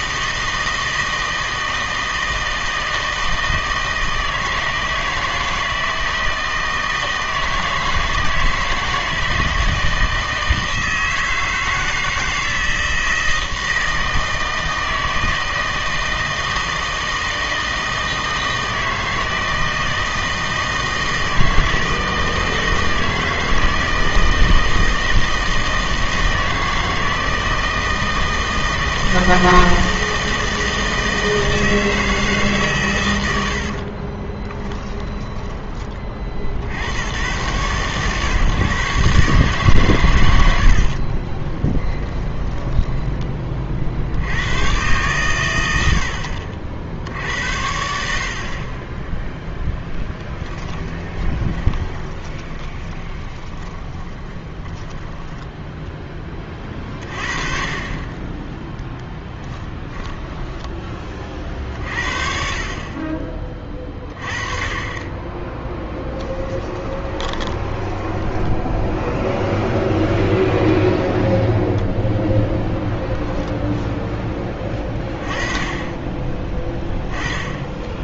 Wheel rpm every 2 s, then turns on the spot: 160, 160, 160, 160, 160, 160, 160, 160, 160, 160, 160, 160, 160, 160, 160, 160, 130, 10, 70, 140, 70, 20, 120, 60, 30, 10, 20, 10, 30, 10, 20, 40, 30, 20, 10, 0, 0, 20, 10.
34-36 40-44 50-56 58-60 66-68